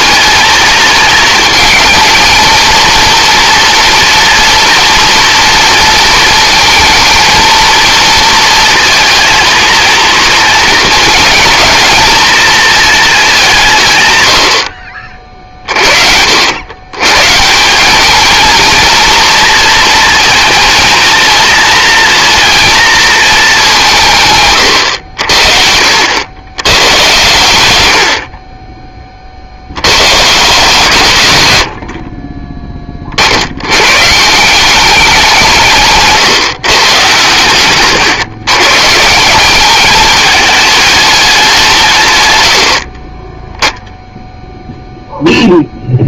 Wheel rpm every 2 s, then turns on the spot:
220, 230, 230, 230, 230, 230, 230, 70, 110, 230, 230, 230, 110, 110, 20, 140, 20, 180, 140, 150, 210, 70, 0.
42-44